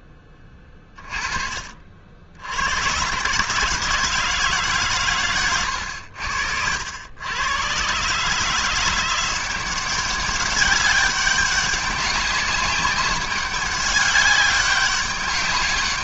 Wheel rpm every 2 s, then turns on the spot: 20, 80, 150, 80, 160, 200, 190, 190.
none